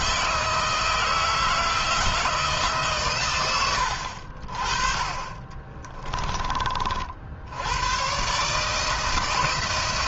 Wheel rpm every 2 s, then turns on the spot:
160, 150, 60, 40, 150.
none